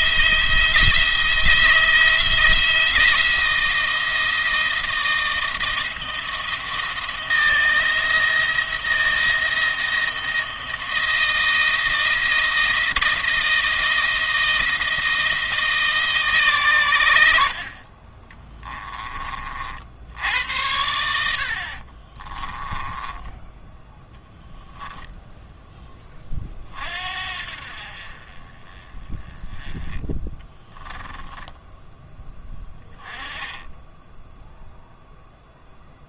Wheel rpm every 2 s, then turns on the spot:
170, 170, 160, 170, 170, 160, 160, 160, 110, 20, 80, 10, 10, 50, 30, 10, 10, 0.
22-24 30-32